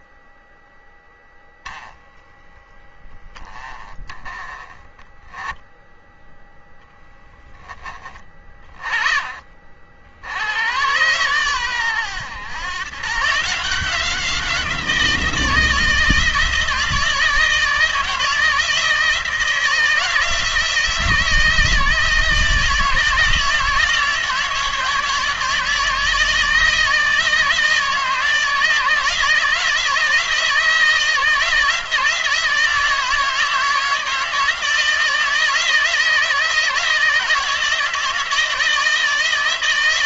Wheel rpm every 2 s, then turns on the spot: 10, 10, 10, 0, 30, 90, 110, 170, 160, 160, 160, 160, 160, 160, 160, 160, 160, 170, 160, 160.
none